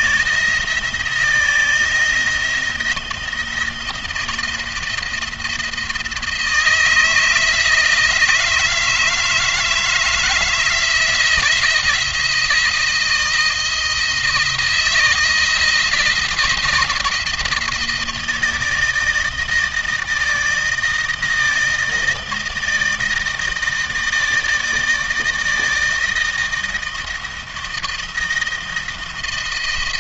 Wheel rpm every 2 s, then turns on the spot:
170, 170, 170, 160, 160, 160, 160, 160, 170, 160, 160, 160, 160, 160, 160.
none